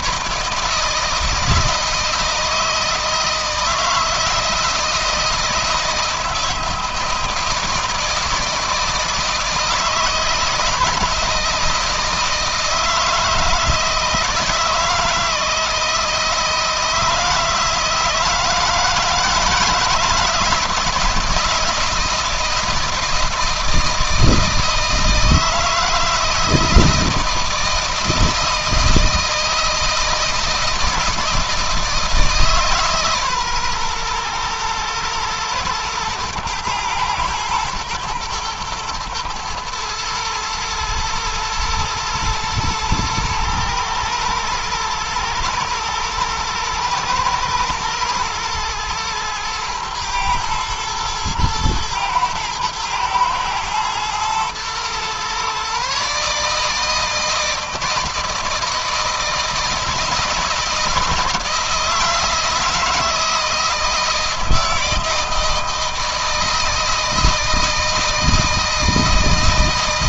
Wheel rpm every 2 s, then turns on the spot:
160, 160, 160, 160, 160, 170, 160, 160, 160, 160, 160, 160, 160, 160, 160, 160, 140, 120, 110, 110, 110, 110, 110, 120, 110, 110, 110, 120, 160, 160, 160, 160, 160, 160, 160.
none